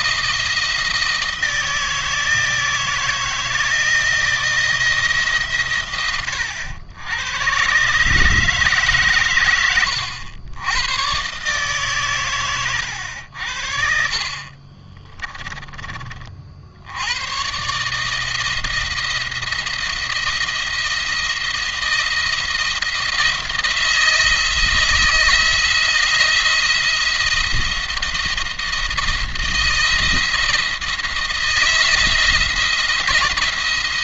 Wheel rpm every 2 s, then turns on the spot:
160, 160, 160, 90, 140, 100, 90, 30, 80, 170, 170, 170, 160, 170, 160, 170, 170.
14-16